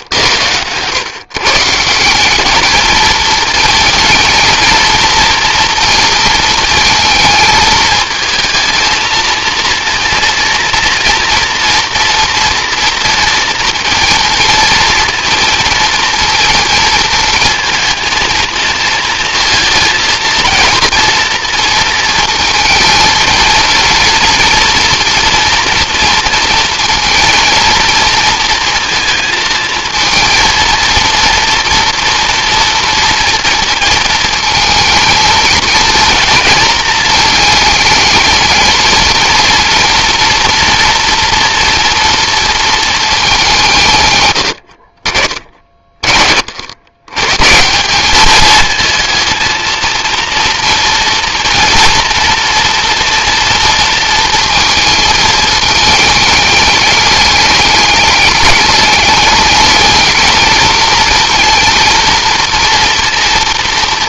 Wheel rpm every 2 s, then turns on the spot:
120, 220, 220, 220, 230, 240, 230, 230, 220, 230, 230, 230, 230, 230, 220, 230, 230, 230, 230, 230, 240, 220, 60, 110, 220, 230, 230, 220, 210, 210, 230, 230.
none